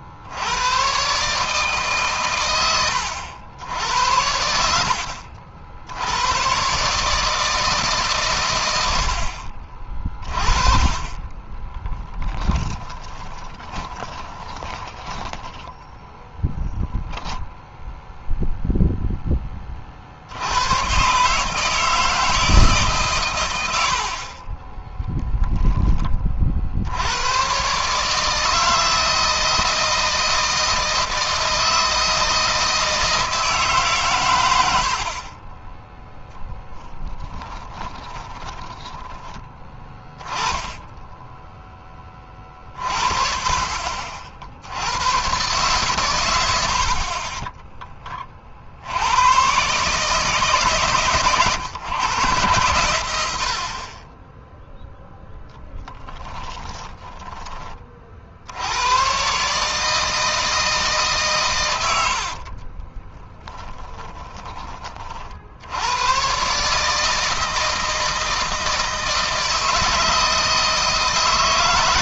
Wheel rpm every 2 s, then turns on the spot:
110, 110, 70, 130, 80, 30, 20, 20, 0, 0, 110, 150, 20, 70, 160, 160, 160, 80, 10, 10, 10, 40, 80, 60, 70, 130, 110, 0, 10, 90, 160, 40, 20, 140, 160, 160.
12-16 34-40 56-58 62-64